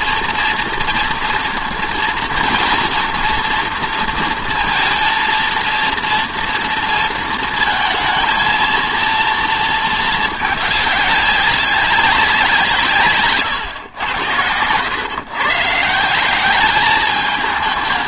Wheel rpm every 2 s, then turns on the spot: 230, 230, 230, 240, 230, 210, 180, 100, 200.
none